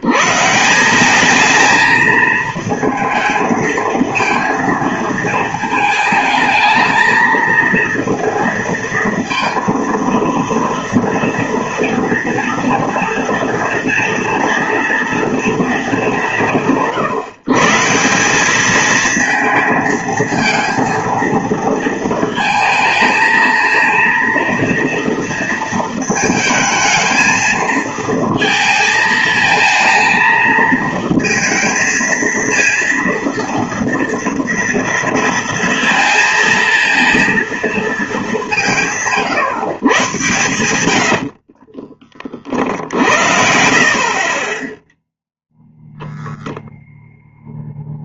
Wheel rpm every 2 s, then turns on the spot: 180, 220, 230, 220, 230, 230, 230, 230, 160, 220, 230, 220, 230, 220, 230, 220, 230, 230, 230, 160, 100, 40, 10, 0.
none